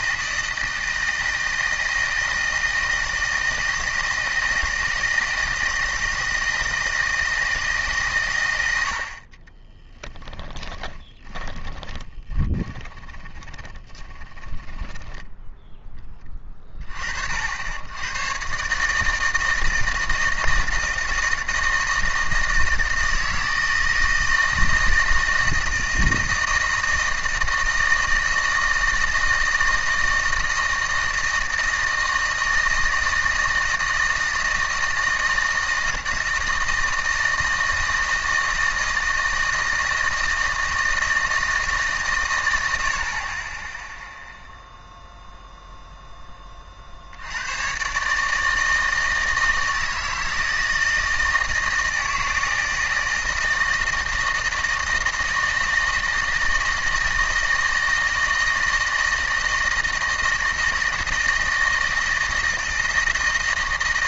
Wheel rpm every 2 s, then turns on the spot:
160, 160, 170, 160, 70, 20, 30, 20, 30, 150, 160, 160, 160, 160, 160, 160, 160, 160, 160, 160, 160, 70, 0, 30, 160, 160, 160, 160, 160, 160, 160, 160.
10-16